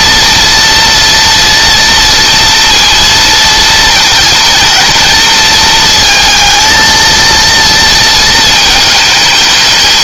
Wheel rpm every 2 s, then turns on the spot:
240, 230, 230, 230, 220.
none